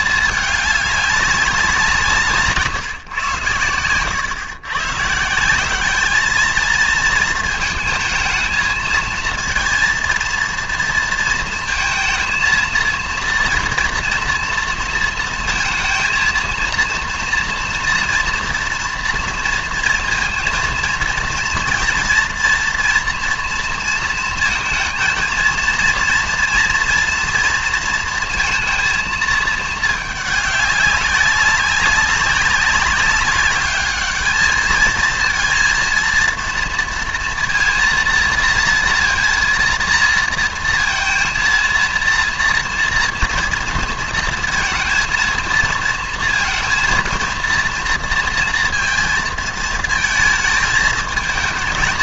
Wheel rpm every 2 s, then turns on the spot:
210, 150, 120, 220, 220, 230, 230, 230, 230, 230, 230, 240, 230, 230, 230, 200, 190, 210, 230, 240, 230, 230, 230, 230, 230, 220.
none